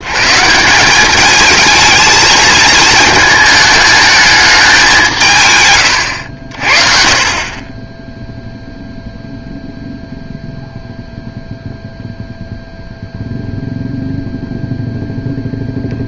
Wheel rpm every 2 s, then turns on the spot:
170, 220, 200, 50, 0, 0, 0, 0.
none